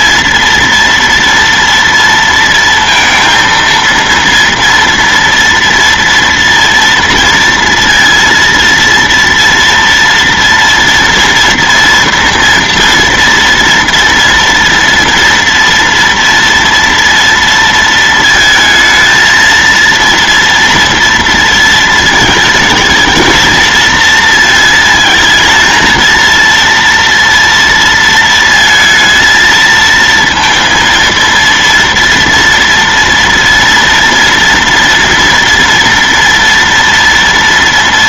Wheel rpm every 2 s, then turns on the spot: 230, 230, 230, 230, 230, 230, 230, 230, 230, 230, 230, 220, 220, 230, 220, 230, 230, 230, 230.
none